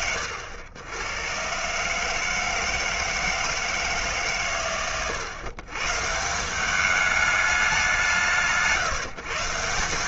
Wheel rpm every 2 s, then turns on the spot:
90, 160, 100, 200, 160.
none